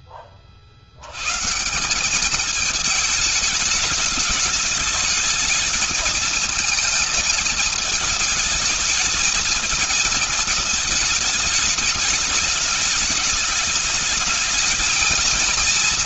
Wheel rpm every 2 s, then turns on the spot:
20, 200, 210, 220, 220, 220, 210, 210.
none